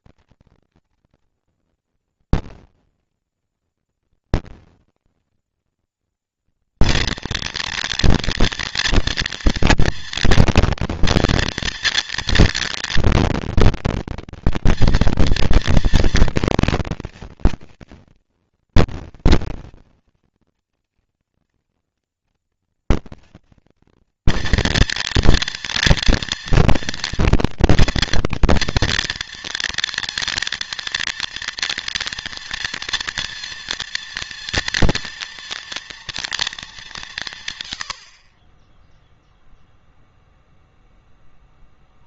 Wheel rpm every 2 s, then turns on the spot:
230, 230, 230, 230, 240, 240, 230, 230, 230, 230, 230, 230, 240, 230, 230, 230, 230, 230, 160, 0, 0.
none